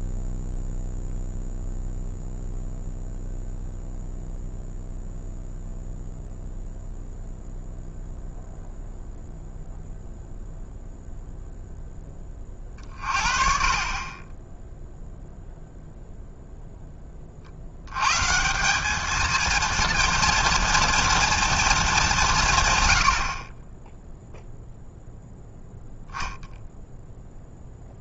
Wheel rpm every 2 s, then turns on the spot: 0, 0, 0, 0, 0, 0, 40, 0, 30, 220, 230, 60, 0, 10.
none